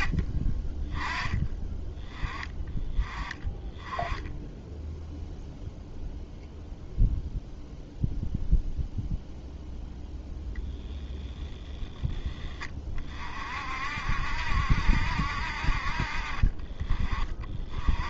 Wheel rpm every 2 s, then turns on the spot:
20, 10, 0, 0, 0, 10, 40, 60, 30.
none